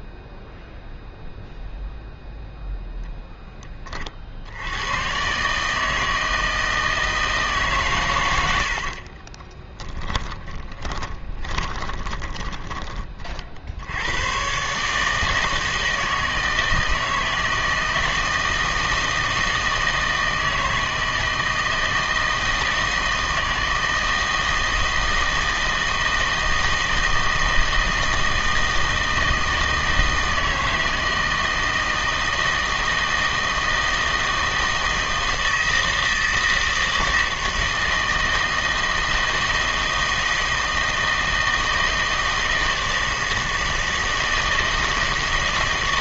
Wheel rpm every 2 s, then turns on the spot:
0, 0, 90, 160, 80, 20, 20, 140, 160, 160, 160, 160, 160, 160, 160, 160, 160, 160, 160, 160, 160, 160, 160.
8-12